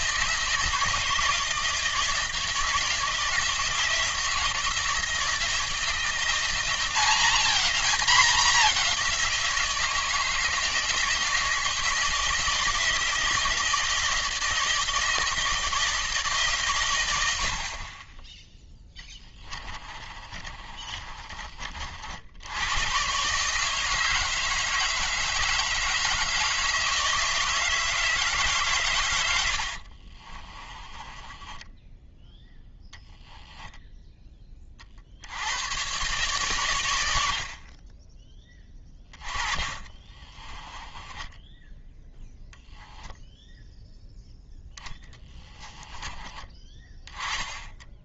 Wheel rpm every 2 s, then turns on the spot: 160, 160, 170, 190, 190, 160, 160, 160, 120, 10, 30, 120, 160, 160, 130, 20, 0, 50, 90, 20, 20, 10, 10, 20.
18-22 30-32 38-42